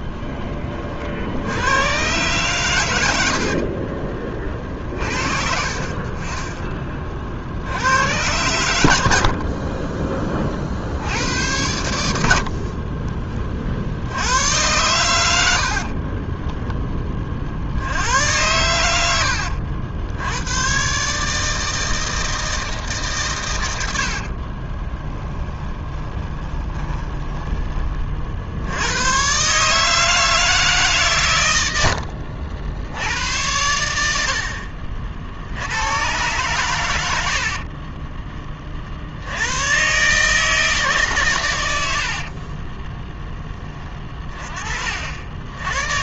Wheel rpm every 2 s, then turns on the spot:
40, 110, 50, 30, 90, 50, 40, 100, 20, 110, 120, 150, 20, 20, 90, 150, 80, 50, 100, 60, 150, 20, 50.
24-28 34-36 42-44